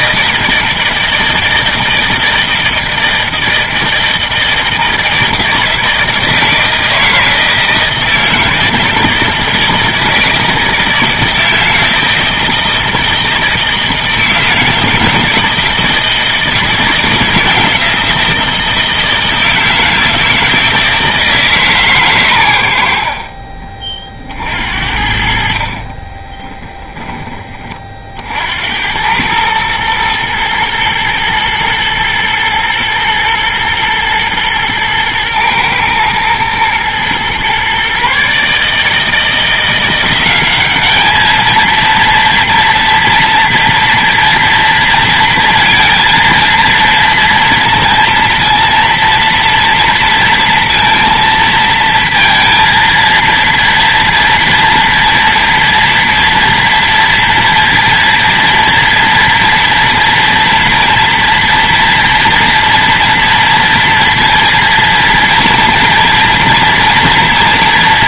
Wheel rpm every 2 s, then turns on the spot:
160, 160, 160, 160, 160, 160, 160, 160, 160, 160, 160, 80, 60, 10, 90, 120, 120, 110, 120, 150, 200, 230, 230, 230, 230, 230, 230, 230, 230, 230, 230, 230, 230, 230.
none